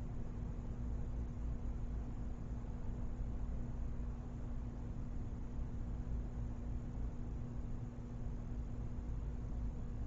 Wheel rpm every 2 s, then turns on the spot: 0, 0, 0, 0, 0.
none